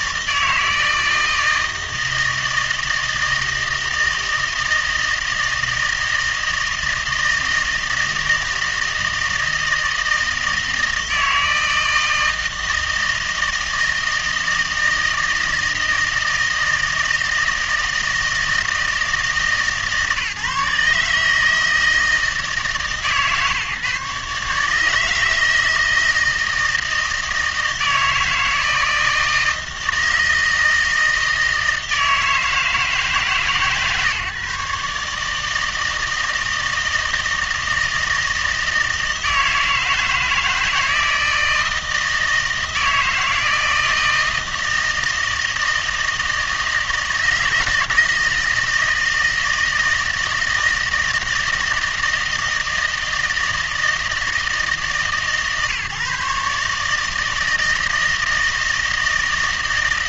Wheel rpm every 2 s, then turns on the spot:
160, 160, 160, 160, 160, 160, 160, 160, 160, 160, 150, 160, 150, 160, 160, 160, 160, 140, 160, 160, 160, 160, 160, 160, 160, 160, 160, 160, 150, 160.
none